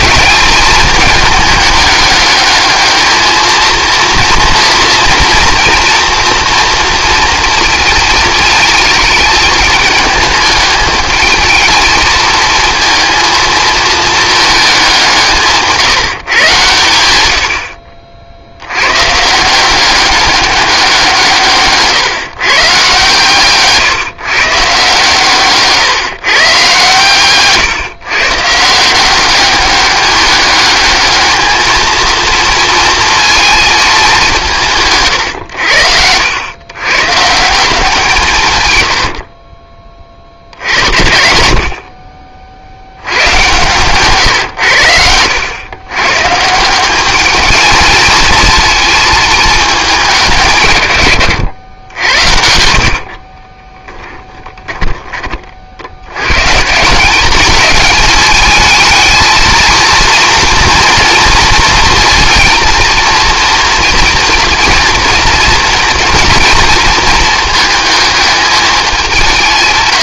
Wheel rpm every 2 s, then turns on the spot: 210, 210, 230, 230, 220, 220, 230, 200, 110, 100, 190, 140, 140, 130, 170, 210, 230, 150, 120, 100, 80, 80, 100, 180, 220, 130, 60, 10, 170, 220, 240, 230, 230, 220, 200.
52-54